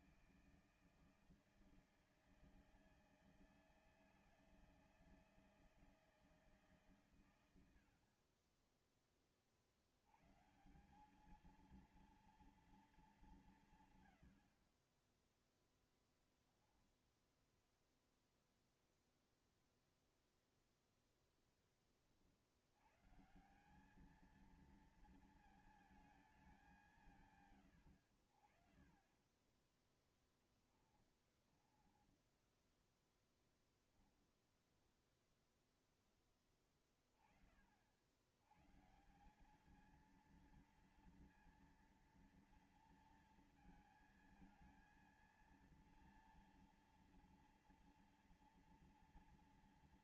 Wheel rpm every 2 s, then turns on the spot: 160, 160, 160, 150, 30, 140, 230, 50, 0, 0, 0, 70, 220, 200, 60, 10, 10, 10, 10, 110, 230, 230, 230, 230, 230.
30-34